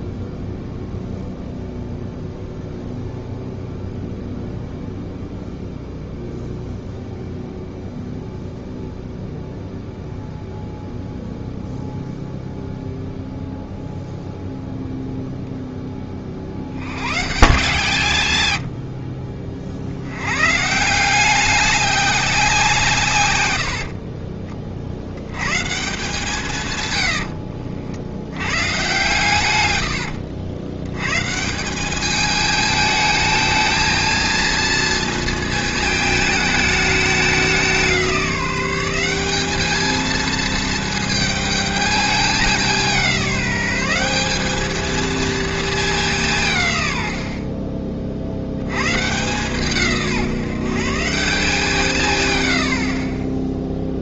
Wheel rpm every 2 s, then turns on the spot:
0, 0, 0, 0, 0, 0, 0, 0, 90, 90, 150, 170, 30, 150, 120, 90, 220, 230, 220, 180, 220, 200, 210, 160, 90, 150, 90.
none